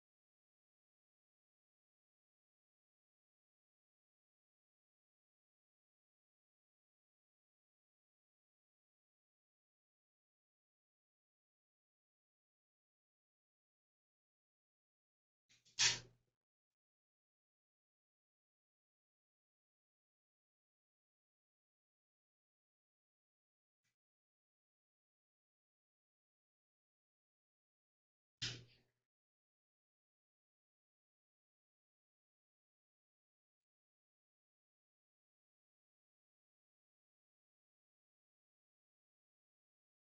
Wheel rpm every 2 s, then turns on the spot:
0, 0, 0, 0, 0, 0, 0, 0, 0, 0, 0, 0, 0, 0, 0, 0, 0, 0, 0, 0.
none